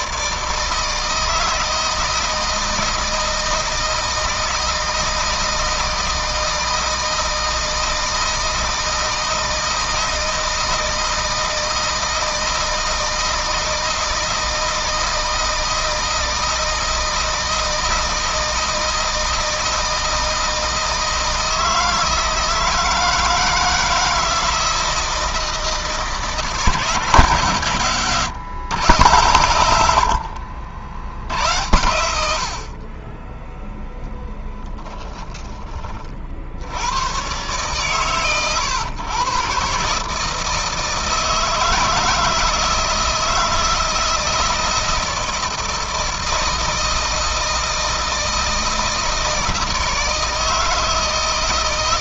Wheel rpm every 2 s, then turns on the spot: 160, 160, 160, 160, 160, 160, 160, 160, 160, 160, 160, 160, 160, 160, 130, 60, 40, 20, 90, 110, 160, 160, 160, 160, 160, 160.
34-36